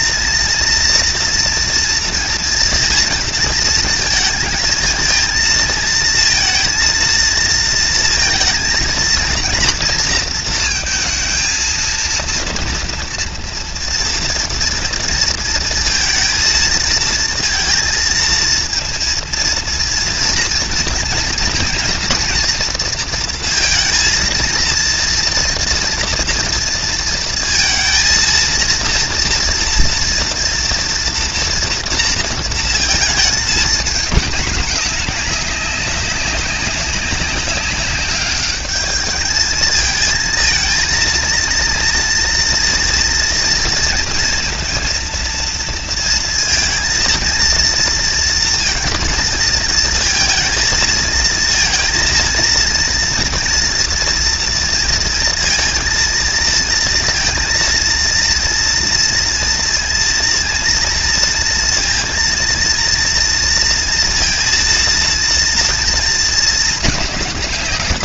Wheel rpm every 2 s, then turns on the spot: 230, 230, 230, 230, 230, 230, 230, 230, 220, 230, 230, 230, 230, 230, 230, 240, 220, 200, 200, 210, 220, 230, 230, 230, 230, 230, 230, 230, 230, 230, 230, 230, 230, 220.
none